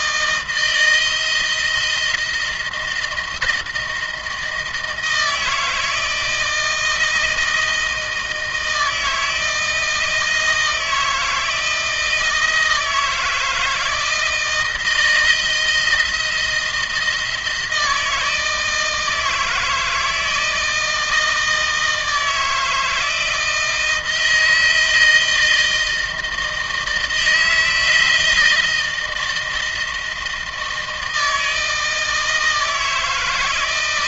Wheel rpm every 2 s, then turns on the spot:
160, 170, 170, 160, 160, 160, 160, 160, 170, 160, 160, 160, 160, 160, 160, 160, 160.
none